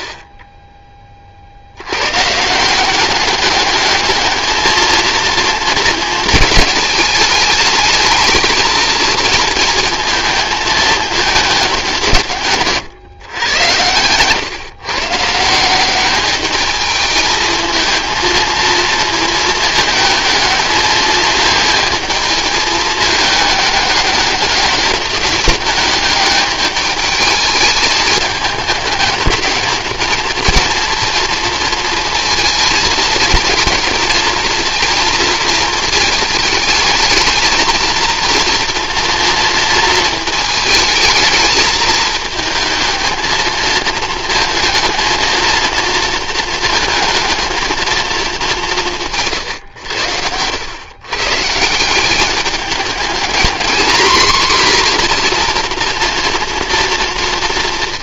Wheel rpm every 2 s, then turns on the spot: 20, 180, 230, 220, 220, 220, 140, 130, 220, 230, 220, 220, 200, 210, 210, 230, 230, 230, 220, 230, 220, 220, 220, 220, 180, 110, 210, 250, 230.
none